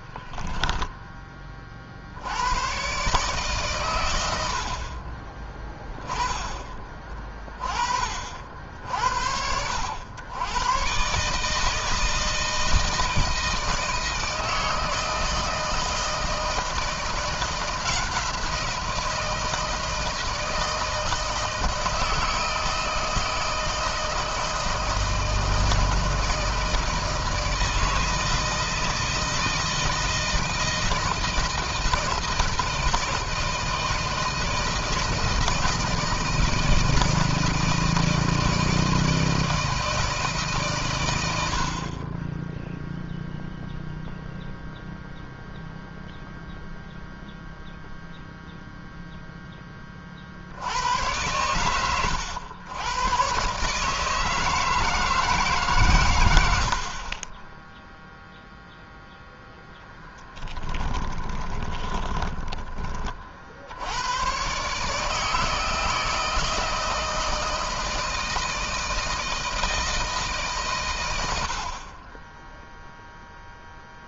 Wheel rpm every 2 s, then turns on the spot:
10, 120, 50, 30, 70, 120, 160, 160, 170, 170, 160, 160, 160, 160, 160, 170, 160, 160, 160, 160, 110, 0, 0, 0, 0, 90, 110, 160, 60, 0, 20, 20, 140, 160, 160, 110, 0.
60-62